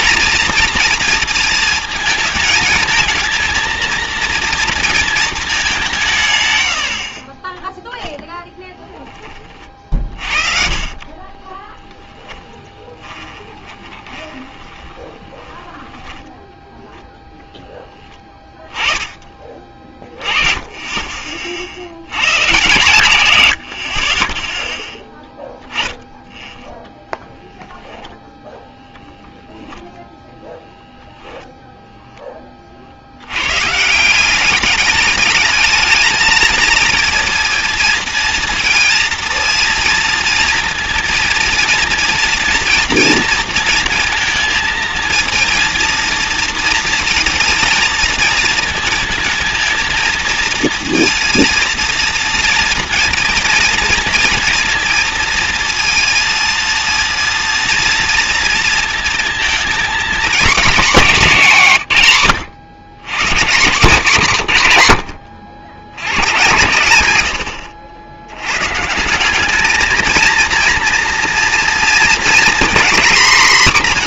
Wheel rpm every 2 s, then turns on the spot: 230, 220, 230, 80, 10, 30, 10, 20, 10, 10, 30, 140, 10, 10, 10, 0, 20, 200, 220, 230, 230, 240, 230, 230, 230, 230, 230, 230, 230, 230, 250, 120, 140, 110, 120, 230, 240.
8-18